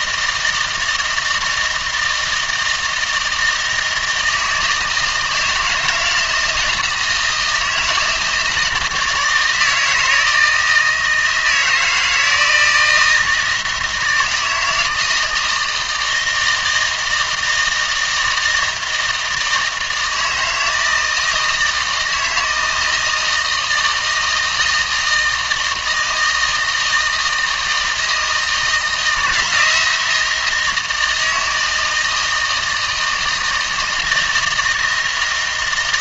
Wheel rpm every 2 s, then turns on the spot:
160, 160, 160, 160, 160, 160, 160, 160, 160, 160, 160, 160, 160, 160, 160, 170, 160, 160.
none